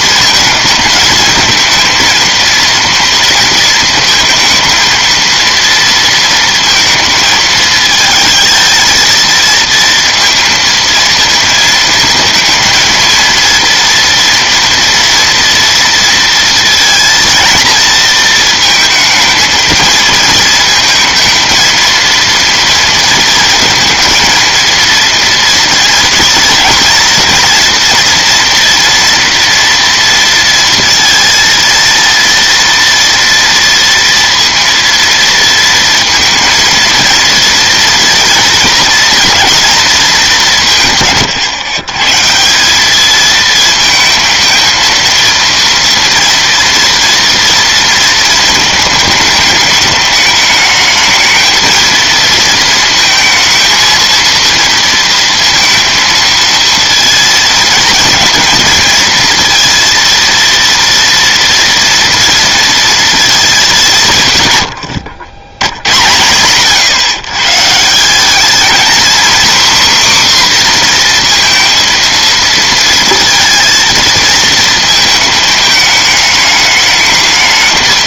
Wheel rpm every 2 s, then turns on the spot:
220, 230, 220, 220, 230, 230, 230, 230, 230, 230, 230, 230, 230, 230, 230, 230, 230, 230, 230, 230, 170, 190, 230, 230, 220, 220, 230, 230, 230, 220, 230, 230, 100, 120, 230, 250, 230, 230, 210.
none